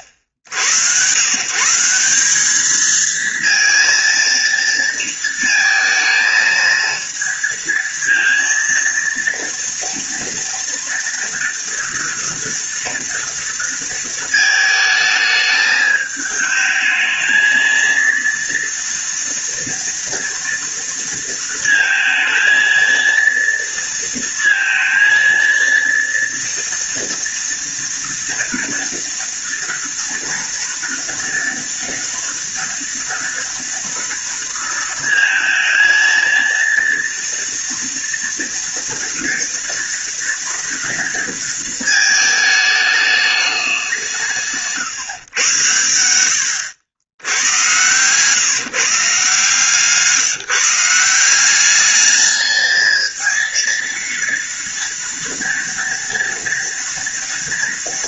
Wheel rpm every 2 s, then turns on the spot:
80, 210, 230, 220, 230, 230, 230, 220, 220, 230, 230, 220, 230, 230, 230, 230, 230, 230, 230, 230, 230, 220, 140, 90, 140, 160, 220, 230, 230.
none